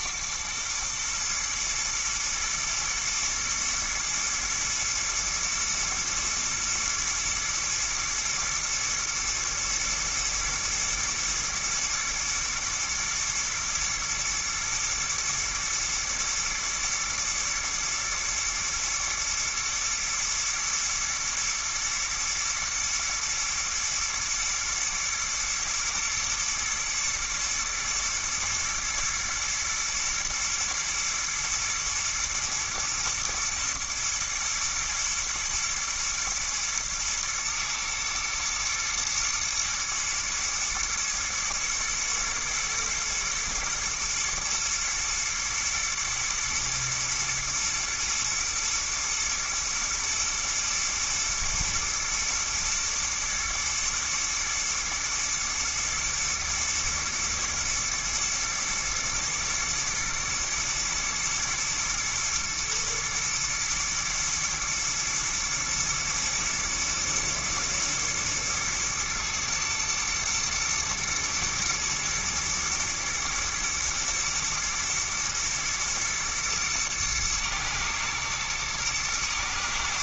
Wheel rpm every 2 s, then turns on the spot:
110, 120, 120, 110, 110, 110, 110, 110, 110, 120, 120, 120, 110, 120, 120, 120, 120, 120, 110, 110, 120, 110, 110, 110, 120, 110, 110, 110, 120, 110, 110, 110, 110, 110, 120, 110, 120, 120, 120, 110.
none